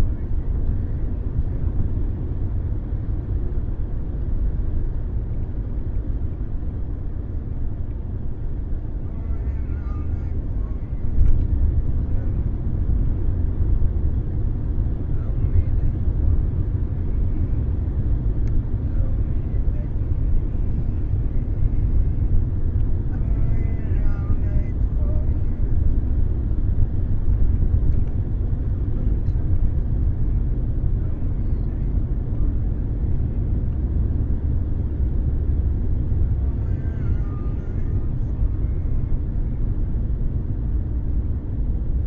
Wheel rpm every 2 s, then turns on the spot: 0, 0, 0, 0, 0, 0, 0, 0, 0, 0, 0, 0, 0, 0, 0, 0, 0, 0, 0, 0, 0.
none